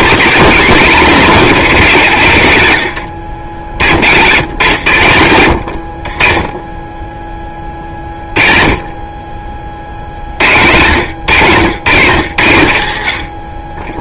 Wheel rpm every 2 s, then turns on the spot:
250, 140, 130, 20, 30, 80, 70.
4-6